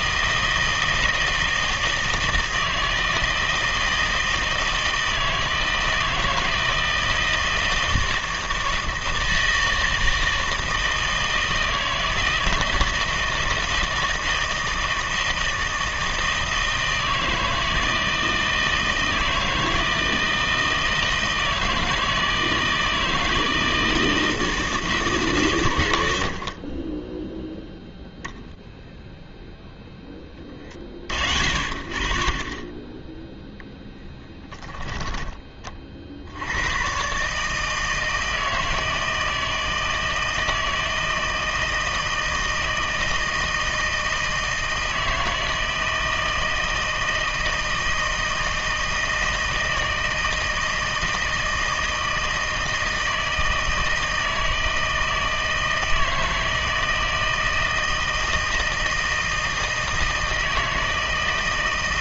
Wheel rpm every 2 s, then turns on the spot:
160, 160, 160, 160, 160, 160, 160, 160, 160, 160, 160, 160, 140, 10, 10, 50, 0, 20, 140, 160, 160, 160, 160, 160, 160, 160, 160, 160, 160, 160, 160.
26-28